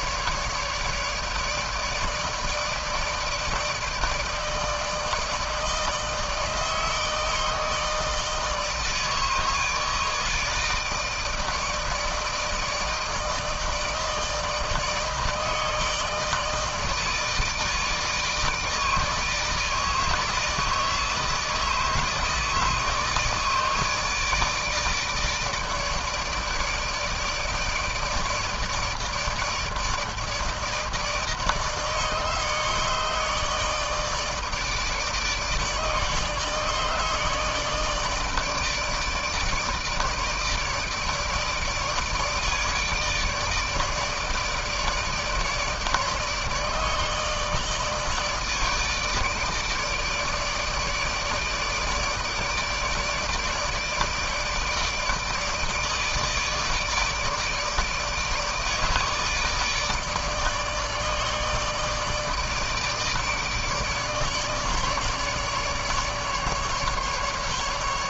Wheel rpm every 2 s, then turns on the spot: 150, 160, 160, 160, 160, 160, 160, 160, 160, 160, 160, 160, 150, 160, 160, 160, 150, 150, 150, 160, 150, 150, 150, 150, 160, 150, 150, 160, 160, 160, 160, 150, 150, 150.
none